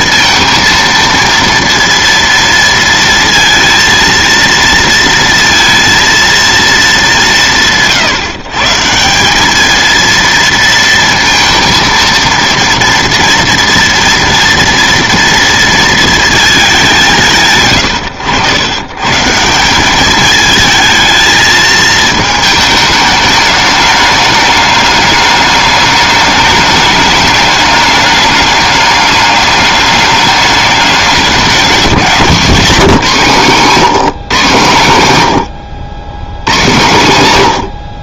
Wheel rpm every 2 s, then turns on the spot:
230, 230, 230, 210, 160, 230, 240, 230, 190, 120, 220, 210, 210, 210, 200, 200, 170, 120, 130.
none